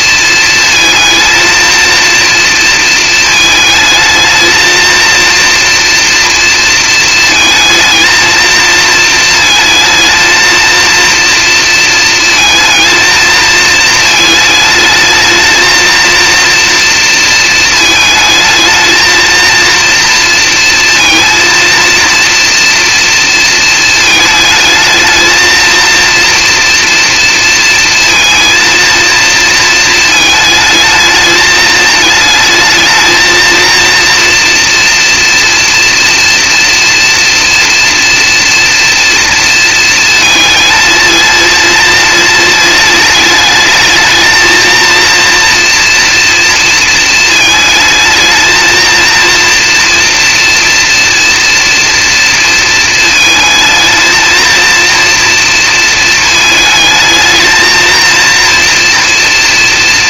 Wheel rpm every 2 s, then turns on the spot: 230, 230, 220, 230, 220, 230, 230, 220, 230, 220, 230, 230, 220, 240, 230, 220, 220, 240, 230, 230, 220, 220, 220, 230, 220, 230, 230, 230, 220, 230.
none